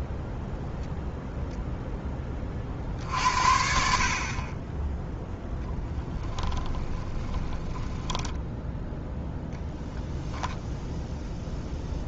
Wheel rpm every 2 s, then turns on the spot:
0, 50, 10, 20, 0, 0.
6-8